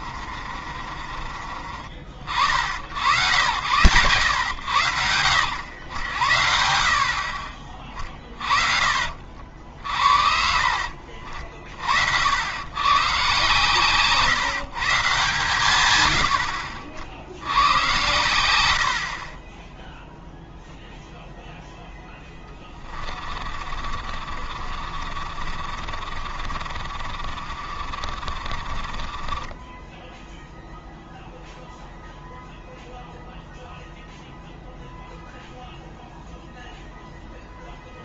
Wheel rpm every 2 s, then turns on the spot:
50, 70, 90, 70, 30, 50, 110, 150, 60, 90, 0, 20, 50, 50, 40, 0, 0, 0, 0.
0-2 6-8 10-12 22-30